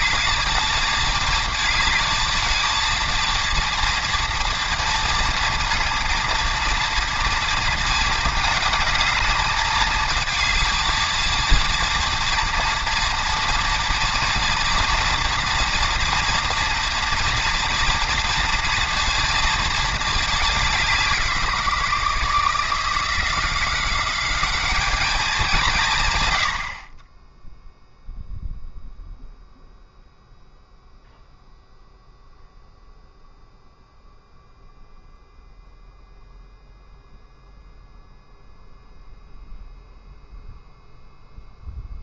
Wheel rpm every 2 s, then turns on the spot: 220, 220, 230, 230, 220, 220, 230, 230, 230, 240, 180, 160, 210, 20, 0, 0, 0, 0, 0, 0, 0.
none